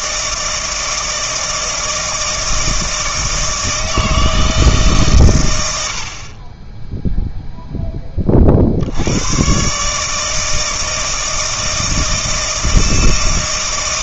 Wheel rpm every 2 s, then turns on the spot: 160, 160, 150, 10, 70, 160, 160.
none